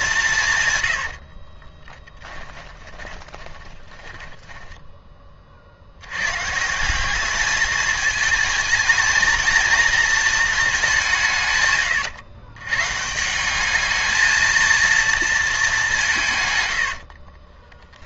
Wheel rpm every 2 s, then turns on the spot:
120, 20, 10, 170, 220, 200, 130, 230, 100.
0-6